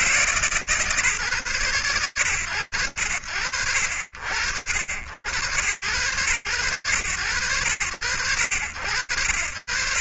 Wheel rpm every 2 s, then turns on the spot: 140, 110, 80, 110, 100.
none